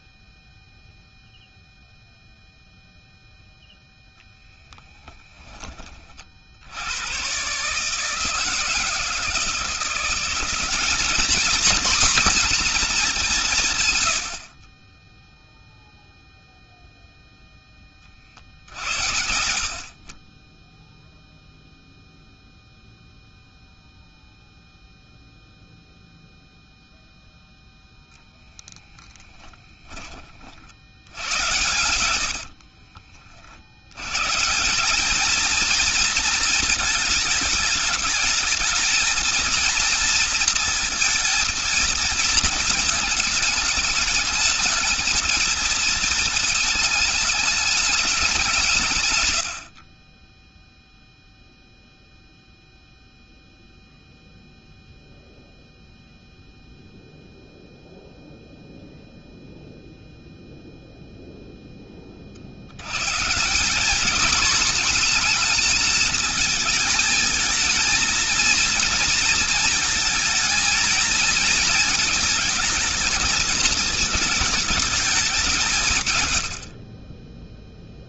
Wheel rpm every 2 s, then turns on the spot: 0, 0, 10, 60, 160, 190, 240, 60, 0, 60, 10, 0, 0, 0, 20, 50, 80, 150, 220, 220, 230, 230, 220, 220, 170, 0, 0, 0, 0, 0, 0, 60, 220, 220, 230, 220, 230, 220, 70.
18-20 28-30 32-34